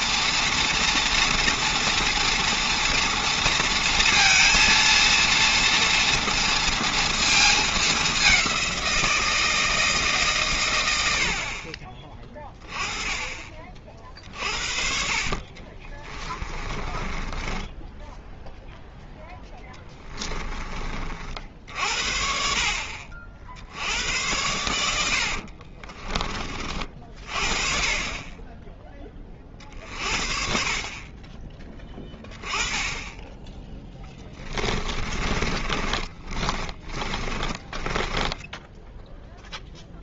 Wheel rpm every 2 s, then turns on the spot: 230, 230, 230, 230, 180, 120, 20, 50, 20, 0, 30, 60, 90, 40, 10, 40, 10, 30, 30, 0.
16-18 34-38